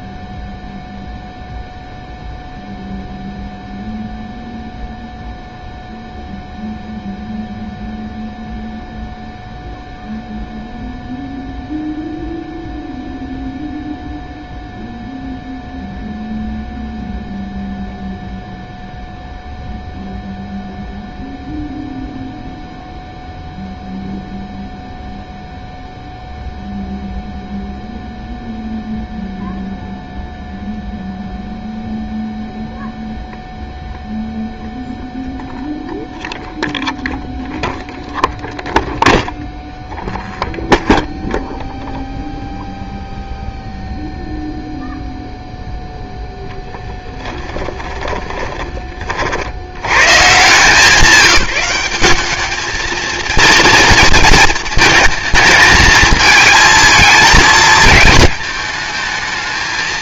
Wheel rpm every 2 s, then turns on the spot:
0, 0, 0, 0, 0, 0, 0, 0, 0, 0, 0, 0, 0, 0, 0, 0, 0, 0, 0, 0, 0, 0, 0, 10, 30, 180, 220, 220, 220, 220.
46-48